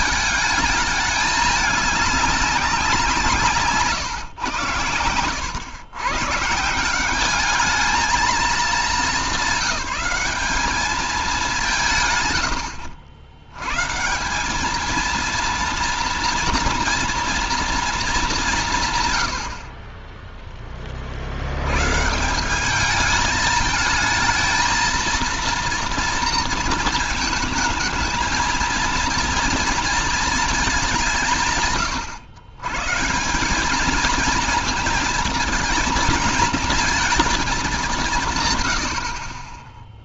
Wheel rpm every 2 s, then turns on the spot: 210, 180, 100, 180, 220, 210, 90, 210, 230, 150, 30, 200, 230, 230, 230, 190, 140, 230, 230, 90.
none